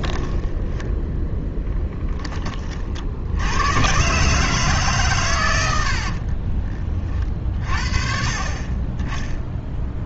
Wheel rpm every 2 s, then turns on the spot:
0, 40, 140, 20, 30.
none